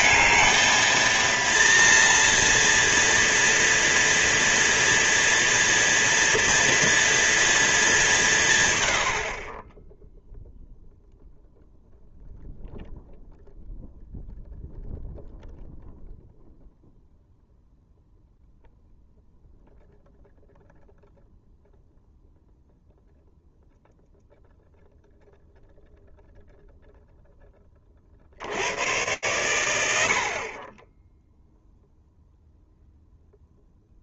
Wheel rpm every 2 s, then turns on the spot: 230, 240, 230, 230, 100, 0, 0, 0, 0, 0, 0, 0, 0, 0, 100, 30, 0.
none